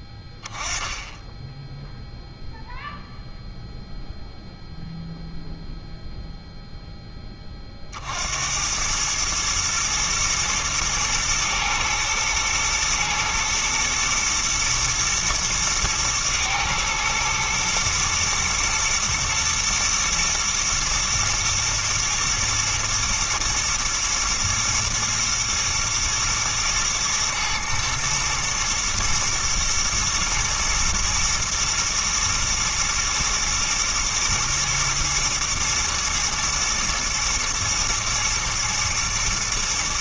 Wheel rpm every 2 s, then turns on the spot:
10, 0, 0, 0, 90, 110, 120, 120, 110, 110, 110, 120, 120, 110, 110, 110, 120, 120, 120, 110.
none